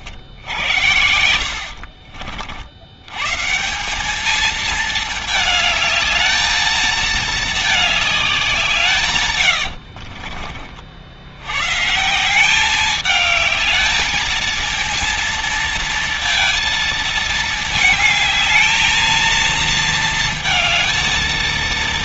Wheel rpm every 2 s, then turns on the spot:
70, 60, 210, 220, 190, 60, 180, 220, 230, 220, 220.
10-12